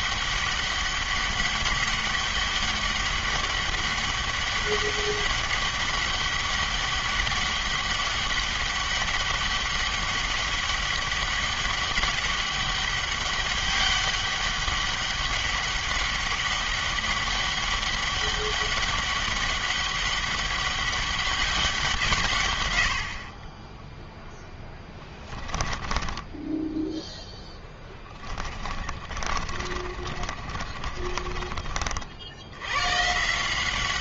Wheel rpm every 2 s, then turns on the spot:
200, 200, 200, 200, 200, 200, 200, 200, 200, 200, 200, 70, 10, 10, 40, 40, 140.
24-32